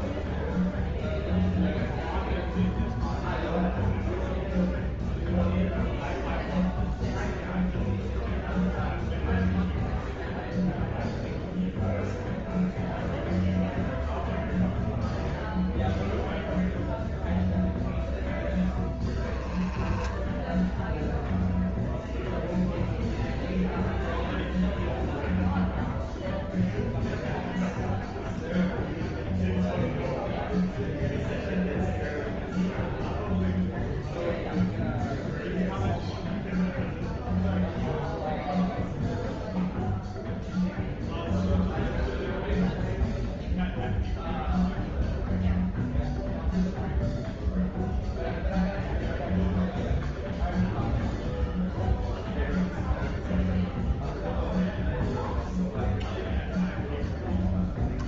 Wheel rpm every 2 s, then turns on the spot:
0, 0, 0, 0, 0, 0, 0, 0, 0, 10, 0, 0, 0, 0, 0, 0, 0, 0, 0, 0, 0, 0, 0, 0, 0, 0, 0, 0, 0.
none